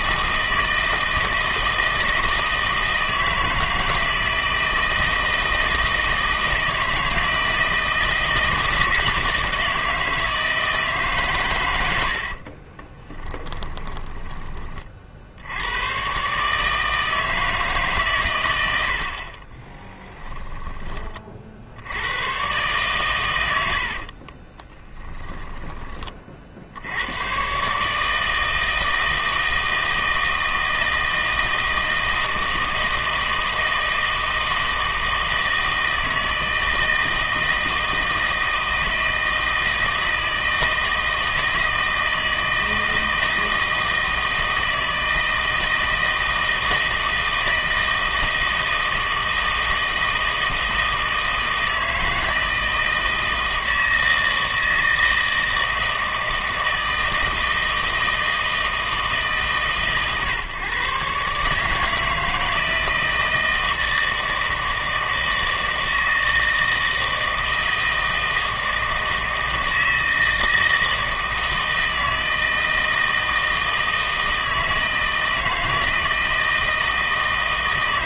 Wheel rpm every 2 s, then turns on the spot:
160, 160, 160, 160, 160, 160, 40, 30, 150, 80, 20, 120, 20, 60, 160, 160, 160, 160, 160, 160, 160, 160, 160, 160, 160, 160, 160, 160, 160, 160, 140, 160, 160, 160, 160, 160, 160, 160, 160.
12-14 20-22 24-26